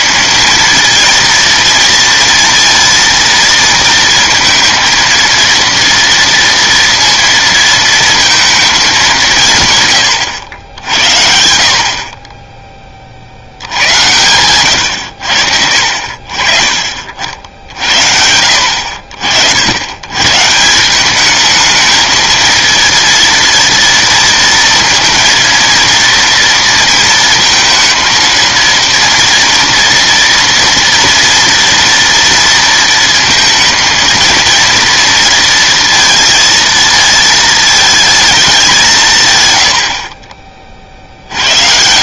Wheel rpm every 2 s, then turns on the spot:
230, 230, 230, 230, 200, 60, 20, 110, 50, 60, 170, 230, 230, 230, 230, 230, 230, 230, 230, 180, 40.
none